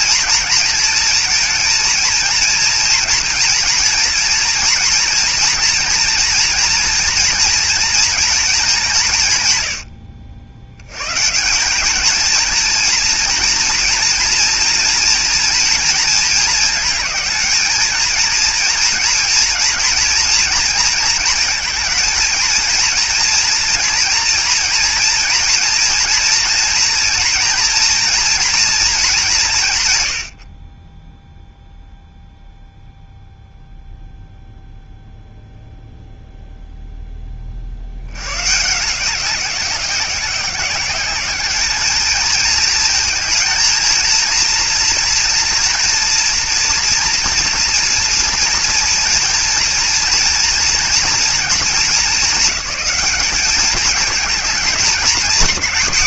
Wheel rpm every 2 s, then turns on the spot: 230, 230, 230, 240, 210, 80, 230, 230, 220, 230, 230, 230, 230, 240, 230, 40, 0, 0, 0, 150, 190, 220, 240, 230, 230, 230, 210, 210.
none